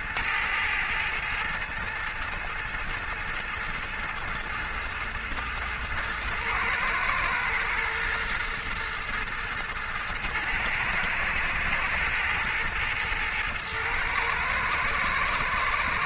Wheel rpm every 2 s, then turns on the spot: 110, 110, 110, 110, 110, 110, 110, 110.
none